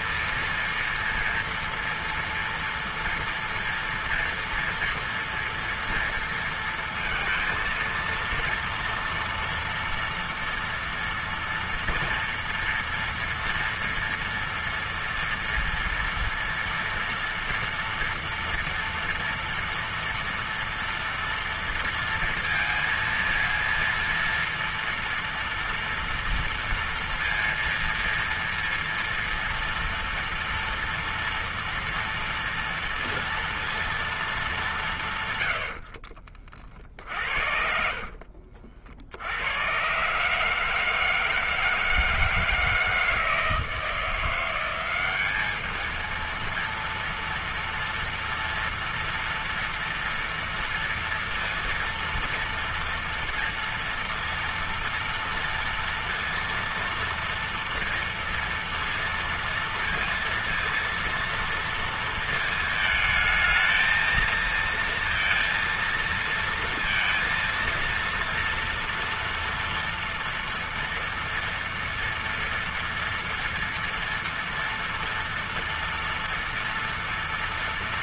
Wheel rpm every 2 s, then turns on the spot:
230, 230, 230, 230, 230, 230, 230, 230, 240, 230, 230, 230, 240, 230, 230, 230, 230, 170, 30, 60, 160, 160, 180, 230, 240, 230, 230, 230, 230, 230, 230, 220, 230, 230, 230, 240, 230, 230, 230.
none